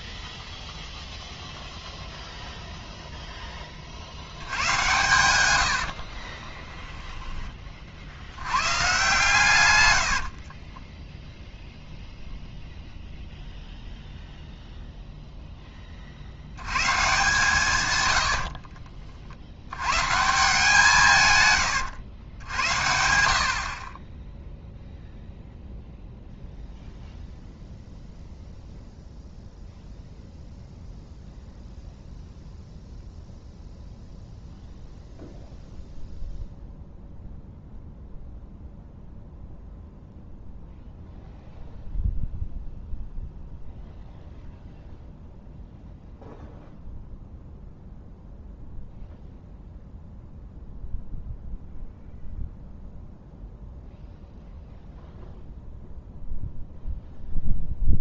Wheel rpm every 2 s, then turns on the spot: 0, 0, 100, 20, 120, 30, 0, 0, 110, 50, 160, 80, 0, 0, 0, 0, 0, 0, 0, 0, 0, 0, 0, 0, 0, 0, 0, 0, 0.
6-8 10-12 18-20